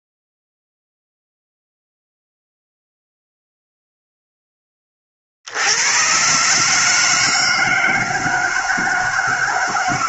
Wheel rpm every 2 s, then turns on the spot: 0, 0, 10, 140, 160.
none